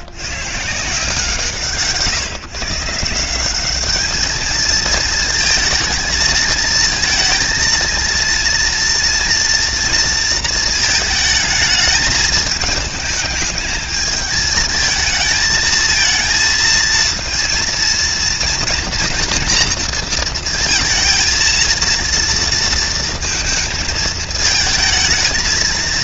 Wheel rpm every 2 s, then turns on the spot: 160, 160, 230, 230, 230, 220, 210, 220, 230, 240, 230, 230, 220.
none